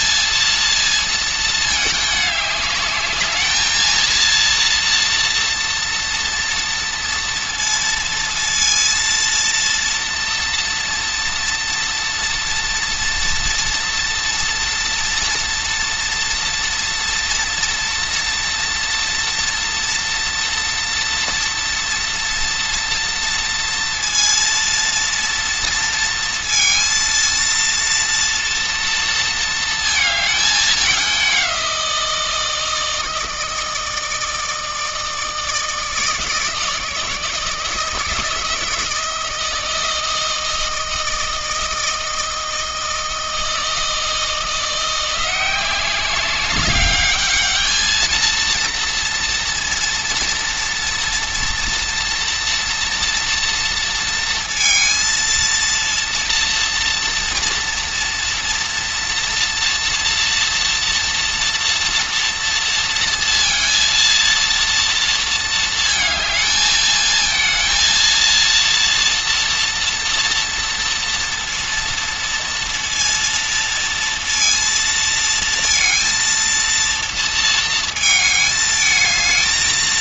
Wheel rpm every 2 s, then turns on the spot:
230, 210, 230, 230, 230, 240, 230, 230, 230, 240, 230, 230, 230, 230, 230, 210, 160, 160, 160, 160, 160, 160, 170, 200, 230, 230, 230, 230, 230, 230, 230, 230, 230, 220, 230, 230, 230, 230, 230, 220.
none